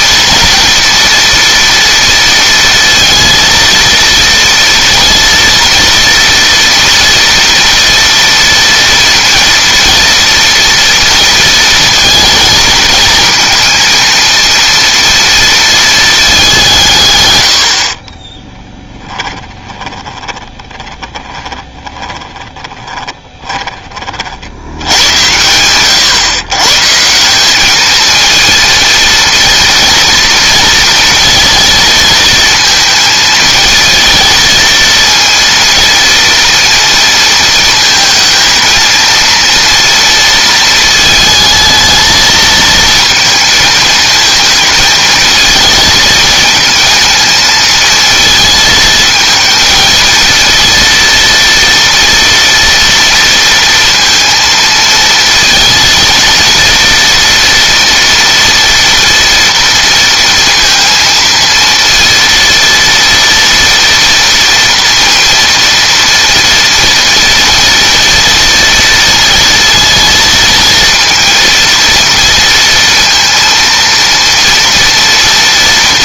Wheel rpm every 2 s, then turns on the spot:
230, 230, 230, 230, 240, 230, 230, 230, 170, 10, 20, 20, 90, 150, 230, 230, 220, 230, 230, 230, 230, 220, 220, 220, 220, 230, 230, 230, 230, 230, 230, 230, 230, 230, 230, 230, 230, 230.
18-24